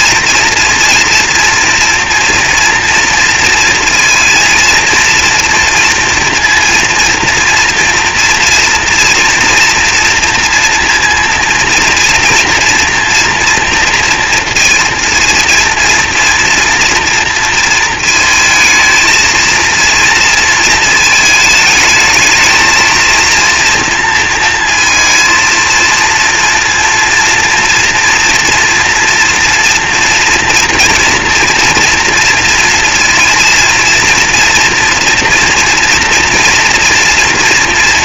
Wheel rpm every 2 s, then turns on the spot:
230, 230, 230, 230, 230, 230, 230, 230, 230, 220, 230, 220, 230, 230, 230, 230, 230, 230, 230.
none